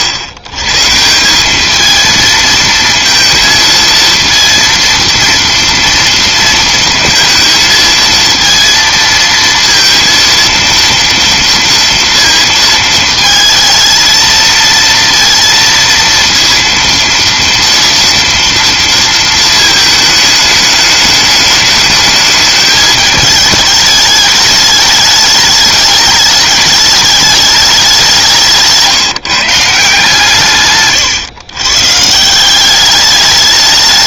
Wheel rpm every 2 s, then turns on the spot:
130, 230, 230, 230, 230, 230, 220, 230, 230, 230, 210, 210, 210, 210, 160, 140, 190.
none